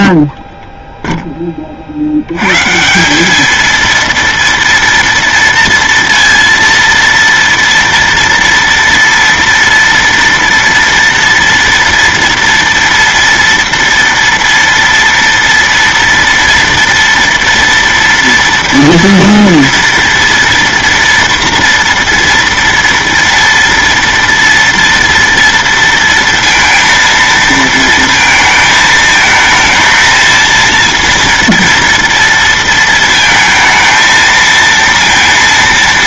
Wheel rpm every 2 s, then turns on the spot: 0, 130, 230, 230, 230, 230, 230, 230, 230, 230, 230, 230, 230, 230, 220, 230, 230, 230.
none